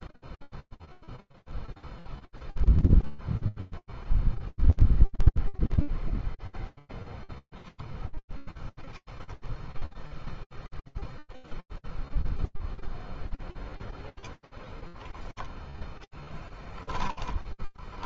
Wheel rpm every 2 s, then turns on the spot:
0, 0, 0, 10, 10, 0, 0, 0, 10.
16-18